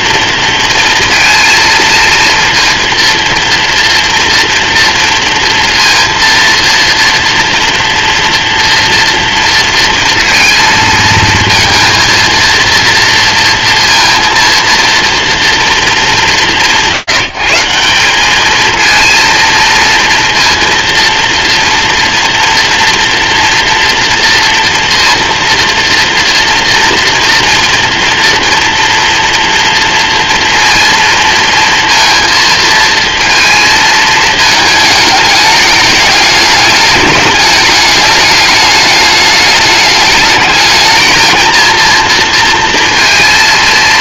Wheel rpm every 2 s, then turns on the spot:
230, 230, 230, 230, 240, 230, 230, 230, 140, 220, 230, 230, 230, 240, 230, 230, 220, 210, 210, 210, 220, 230.
none